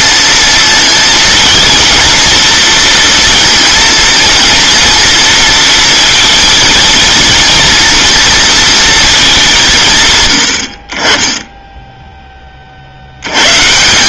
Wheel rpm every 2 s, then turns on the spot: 230, 230, 230, 230, 230, 80, 60.
none